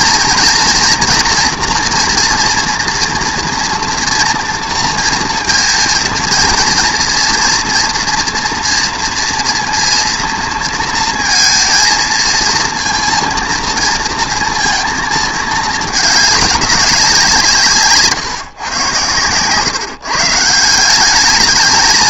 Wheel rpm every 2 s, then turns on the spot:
230, 230, 230, 230, 230, 230, 230, 230, 190, 130, 160.
none